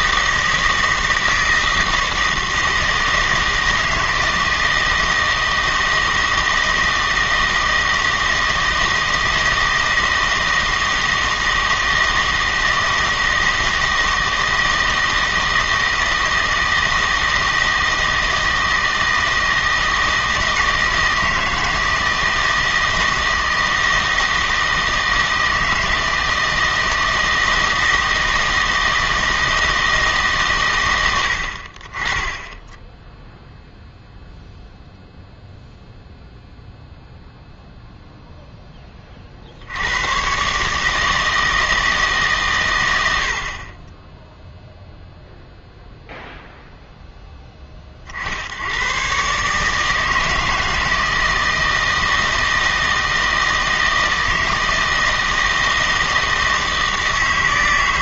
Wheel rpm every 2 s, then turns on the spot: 160, 160, 160, 160, 160, 160, 160, 160, 160, 160, 160, 160, 160, 160, 160, 130, 10, 0, 0, 10, 140, 130, 0, 0, 90, 160, 160, 160, 160.
none